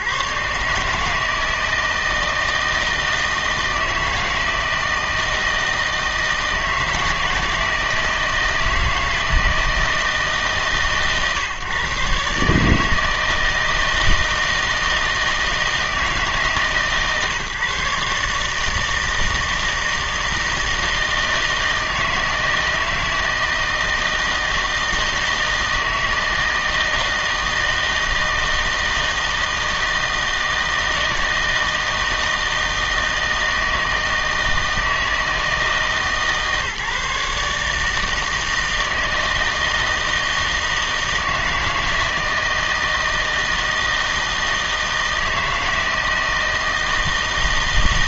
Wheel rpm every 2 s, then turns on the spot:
130, 160, 160, 160, 160, 140, 160, 160, 140, 160, 160, 160, 160, 160, 160, 160, 160, 160, 150, 160, 160, 160, 160, 160.
none